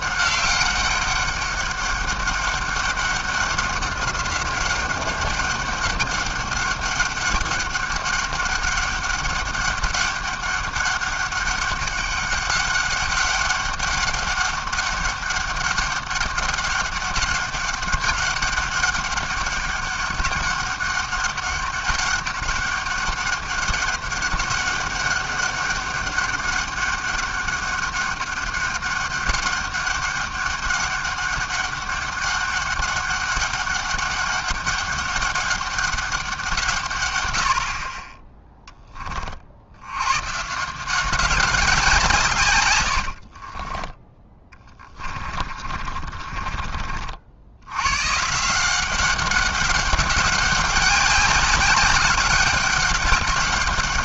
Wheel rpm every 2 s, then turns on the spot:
200, 200, 190, 200, 200, 200, 200, 200, 200, 200, 200, 200, 200, 200, 200, 200, 200, 200, 160, 10, 160, 120, 20, 30, 170, 200, 200.
44-48